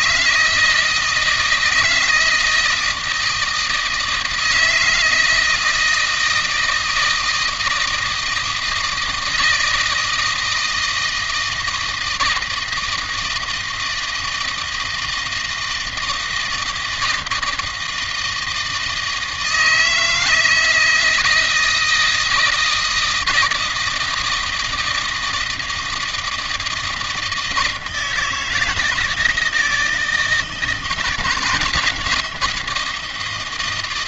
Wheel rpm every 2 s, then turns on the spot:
160, 160, 160, 160, 160, 160, 160, 160, 170, 160, 160, 160, 160, 160, 160, 170, 170.
none